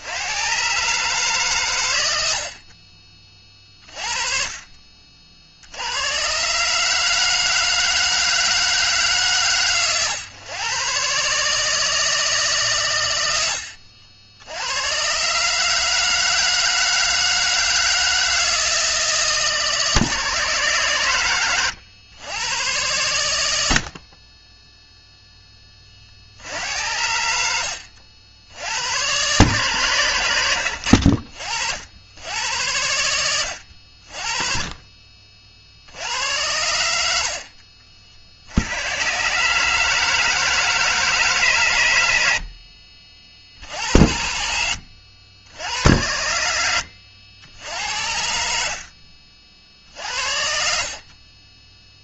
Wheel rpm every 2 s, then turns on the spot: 140, 40, 50, 150, 150, 130, 110, 110, 160, 160, 120, 110, 0, 80, 110, 70, 90, 40, 80, 110, 160, 50, 70, 80, 60, 50.
48-50